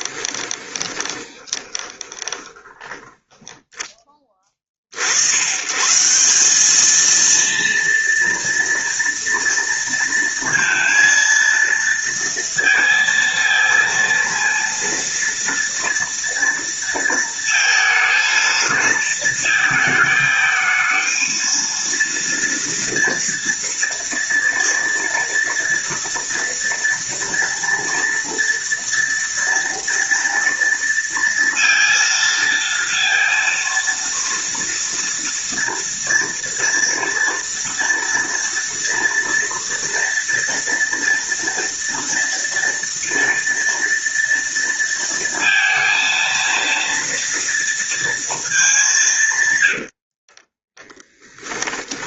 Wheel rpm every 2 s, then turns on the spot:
20, 10, 50, 210, 230, 230, 230, 230, 230, 230, 220, 230, 230, 230, 230, 230, 230, 230, 230, 230, 230, 230, 230, 230, 190, 10.
0-4 50-52